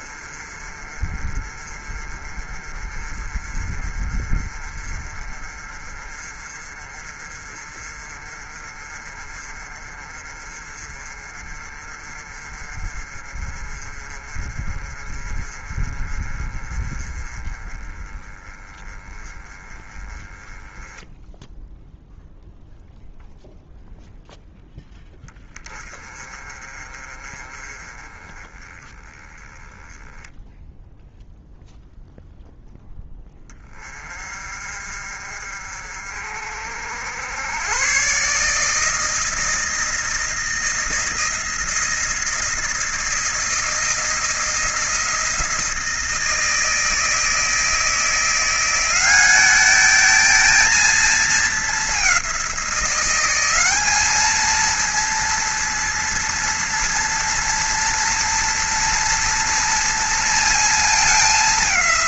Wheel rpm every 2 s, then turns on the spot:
40, 40, 40, 40, 40, 40, 40, 30, 30, 20, 10, 0, 10, 30, 10, 0, 10, 50, 70, 160, 160, 160, 160, 160, 190, 220, 180, 230, 230, 230, 220.
none